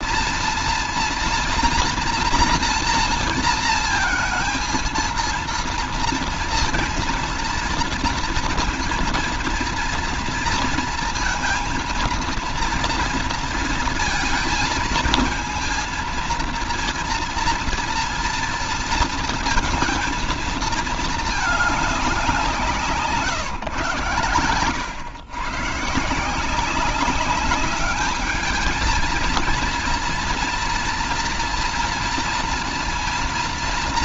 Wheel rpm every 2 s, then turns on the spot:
230, 230, 230, 230, 230, 230, 230, 220, 230, 230, 230, 190, 110, 160, 220, 240, 230.
none